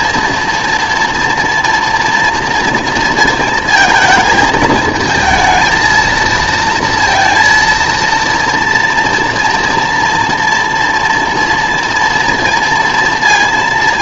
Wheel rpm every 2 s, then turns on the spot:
240, 230, 220, 230, 230, 230, 230.
none